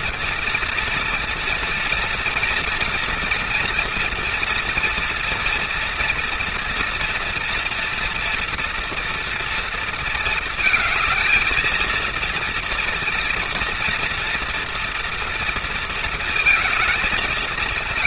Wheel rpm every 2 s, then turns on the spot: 230, 230, 230, 230, 230, 220, 230, 230, 230.
none